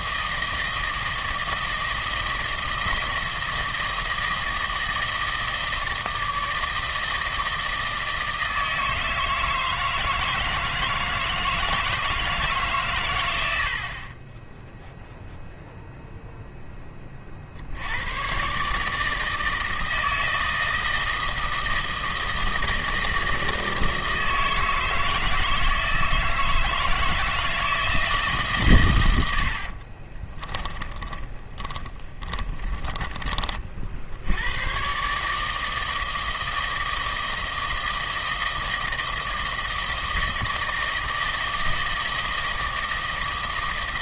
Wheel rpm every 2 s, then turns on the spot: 160, 160, 160, 160, 160, 160, 140, 0, 20, 150, 160, 160, 160, 160, 120, 20, 20, 110, 160, 160, 160, 160.
30-34